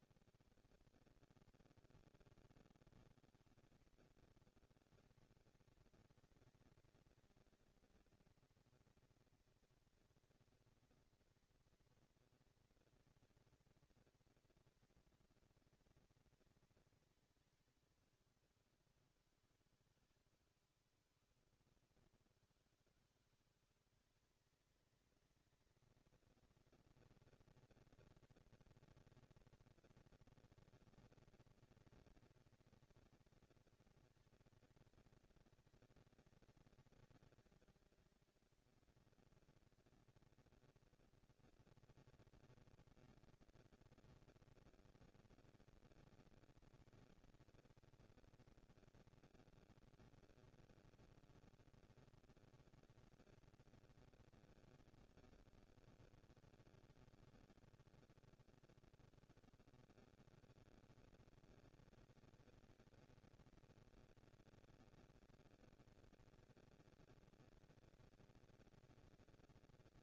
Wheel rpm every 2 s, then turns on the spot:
70, 10, 120, 220, 230, 240, 230, 230, 220, 180, 160, 160, 210, 220, 230, 220, 230, 230, 230, 210, 230, 230, 230, 220, 230, 230, 230, 200, 160, 110, 130, 220, 230, 230, 230.
none